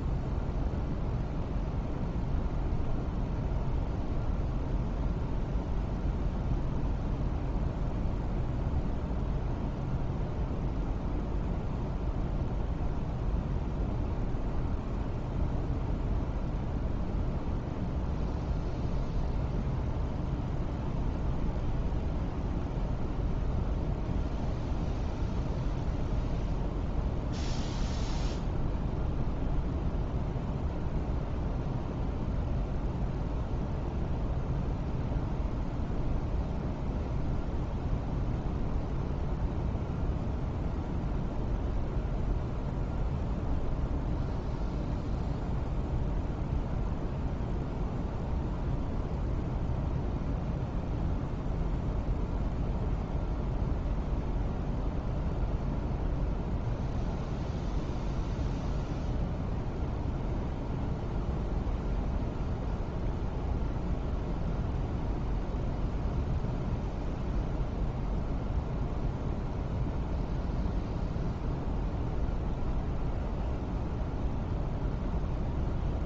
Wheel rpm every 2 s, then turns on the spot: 0, 0, 0, 0, 0, 0, 0, 0, 0, 0, 0, 0, 0, 0, 0, 0, 0, 0, 0, 0, 0, 0, 0, 0, 0, 0, 0, 0, 0, 0, 0, 0, 0, 0, 0, 0, 0, 0.
none